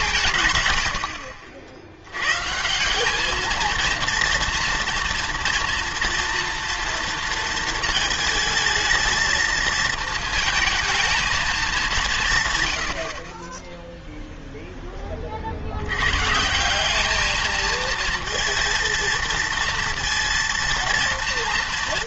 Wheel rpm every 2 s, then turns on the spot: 110, 160, 230, 230, 220, 230, 110, 0, 170, 230, 230.
none